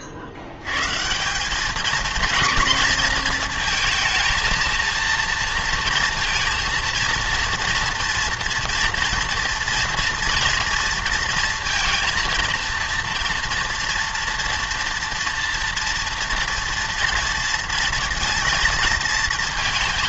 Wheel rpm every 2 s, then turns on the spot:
110, 230, 230, 230, 230, 230, 230, 230, 230, 220.
none